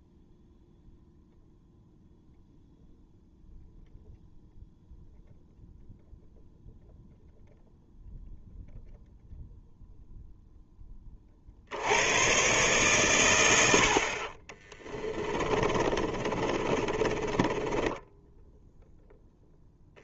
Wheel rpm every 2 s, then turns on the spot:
0, 0, 0, 0, 0, 10, 120, 30, 40, 10.
16-20